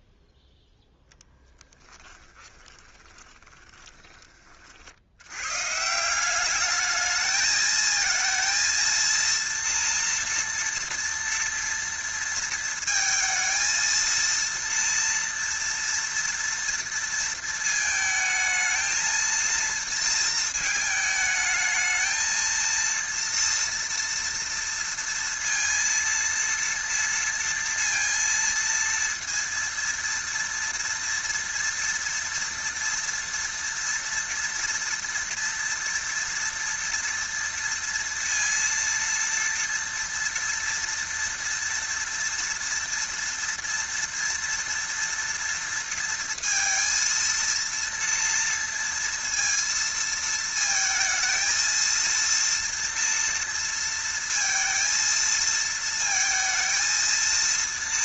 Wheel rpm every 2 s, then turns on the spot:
10, 30, 90, 210, 230, 230, 230, 230, 230, 230, 220, 230, 230, 230, 230, 230, 240, 230, 230, 230, 230, 230, 230, 230, 230, 220, 230, 230, 230.
2-4